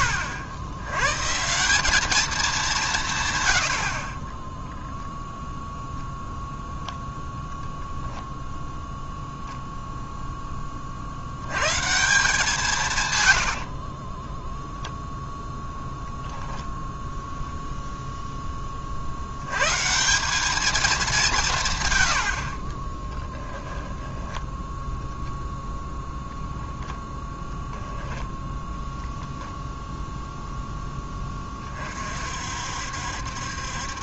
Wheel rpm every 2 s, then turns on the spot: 120, 170, 0, 0, 0, 50, 150, 0, 0, 40, 210, 30, 0, 10, 0, 10, 60.
22-24